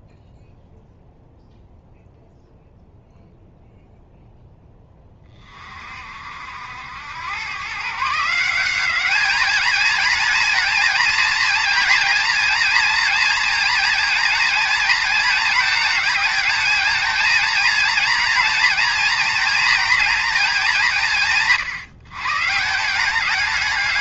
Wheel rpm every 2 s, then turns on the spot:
0, 0, 10, 80, 180, 230, 230, 220, 220, 230, 200, 170.
none